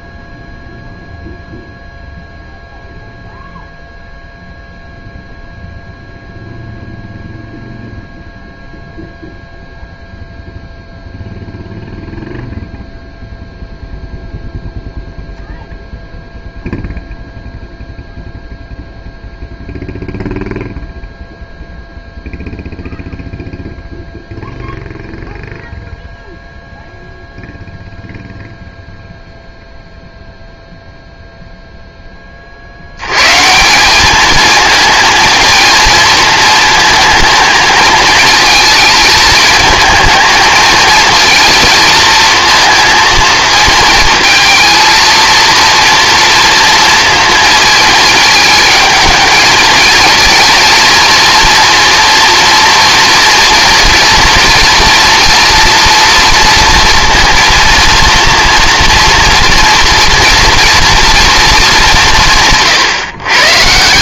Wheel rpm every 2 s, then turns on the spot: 0, 0, 0, 0, 0, 0, 0, 0, 0, 0, 0, 0, 0, 0, 0, 0, 80, 220, 220, 220, 230, 230, 230, 230, 220, 230, 230, 230, 230, 230, 230, 140.
none